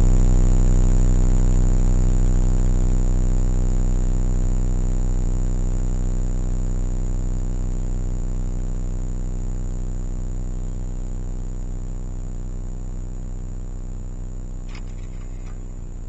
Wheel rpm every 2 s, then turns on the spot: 0, 0, 0, 0, 0, 0, 0, 0.
none